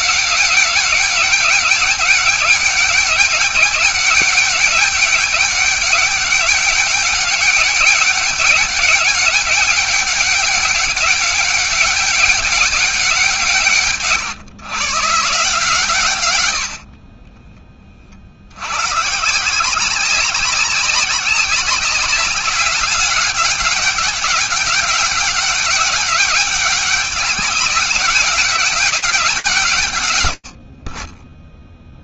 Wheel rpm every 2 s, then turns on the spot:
190, 200, 200, 200, 200, 200, 190, 150, 70, 70, 190, 200, 200, 200, 210, 70.
none